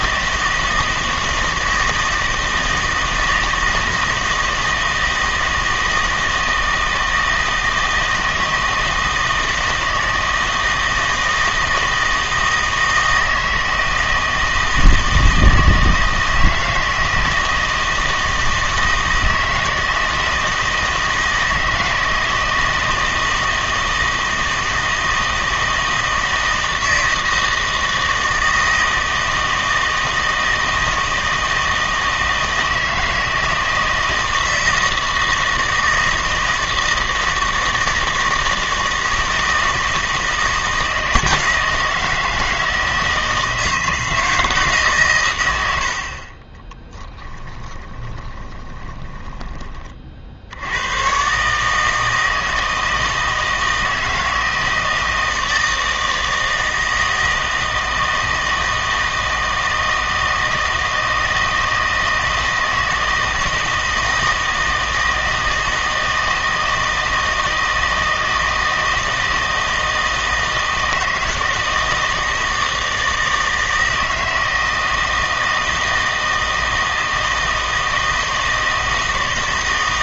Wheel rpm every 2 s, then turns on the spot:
160, 160, 160, 160, 160, 160, 160, 160, 160, 160, 160, 160, 160, 160, 160, 160, 160, 160, 160, 160, 160, 160, 150, 30, 20, 80, 160, 160, 160, 160, 160, 160, 160, 160, 160, 160, 160, 160, 160, 160.
46-50